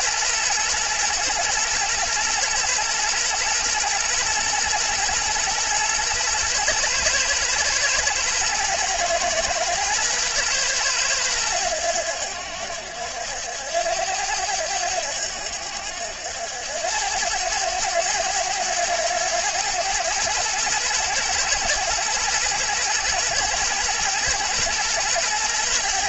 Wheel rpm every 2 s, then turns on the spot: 120, 120, 110, 110, 120, 110, 70, 80, 90, 110, 110, 120, 120.
none